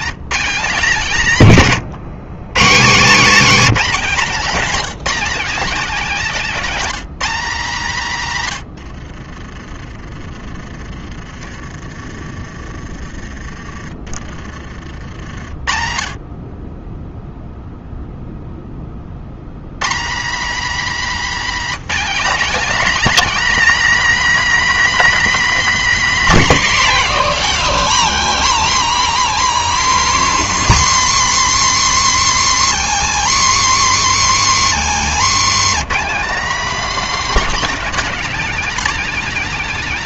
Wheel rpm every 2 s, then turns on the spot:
200, 190, 220, 250, 90, 30, 30, 50, 10, 40, 240, 260, 290, 180, 170, 160, 140, 140, 260, 250.
2-4 8-10 34-36